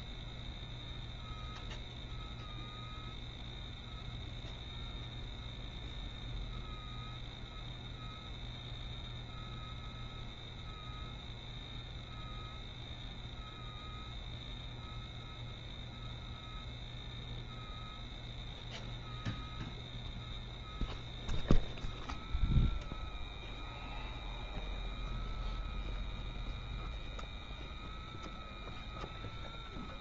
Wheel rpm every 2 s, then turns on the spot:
0, 0, 0, 0, 0, 0, 0, 0, 0, 0, 0, 0, 0, 0, 0.
none